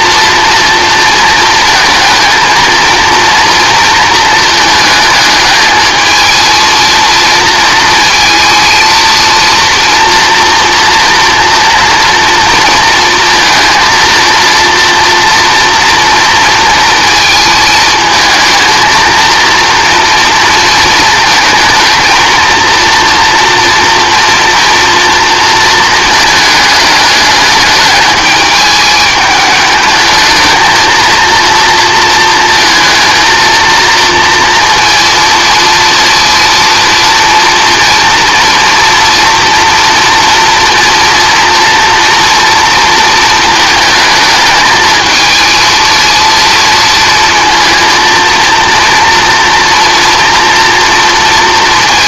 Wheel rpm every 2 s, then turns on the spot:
230, 230, 220, 230, 230, 230, 230, 230, 230, 230, 230, 230, 230, 210, 210, 230, 230, 230, 230, 230, 240, 230, 220, 230, 230, 230.
none